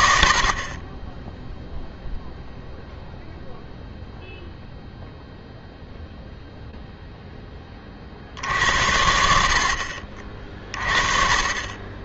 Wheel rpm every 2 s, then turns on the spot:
30, 0, 0, 0, 70, 30.
none